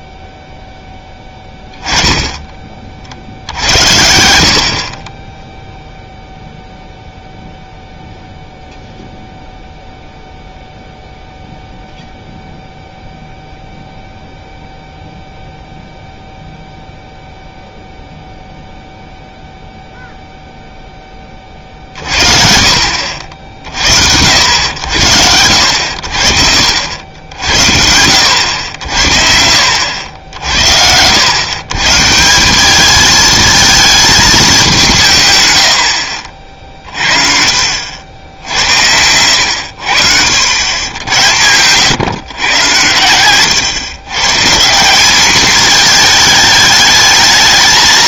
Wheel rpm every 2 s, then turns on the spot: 0, 20, 60, 0, 0, 0, 0, 0, 0, 0, 0, 50, 80, 60, 80, 80, 190, 190, 40, 80, 90, 120, 160, 220.
none